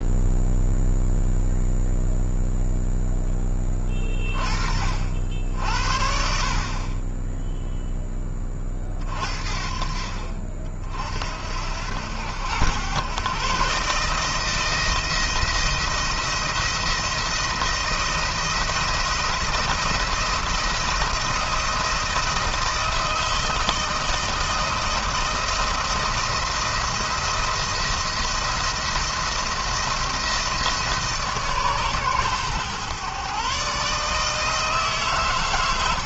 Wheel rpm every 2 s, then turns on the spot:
0, 0, 40, 40, 30, 50, 100, 170, 170, 170, 170, 170, 160, 170, 170, 160, 130, 150.
none